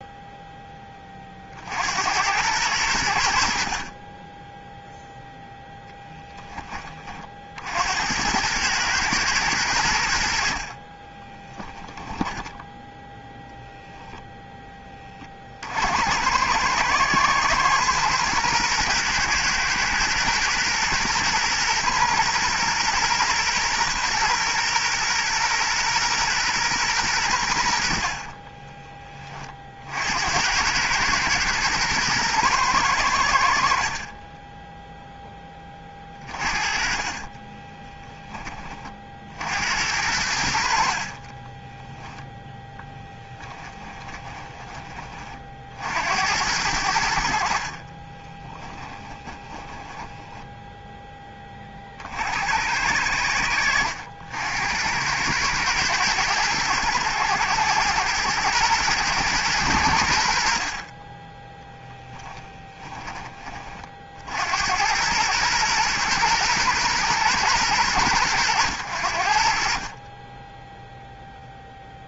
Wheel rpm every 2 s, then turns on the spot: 10, 100, 0, 20, 110, 30, 10, 20, 110, 120, 120, 120, 120, 120, 30, 110, 110, 10, 30, 40, 60, 10, 30, 80, 20, 10, 80, 80, 110, 120, 30, 20, 90, 120, 100, 0.
12-14 36-38 42-44 48-50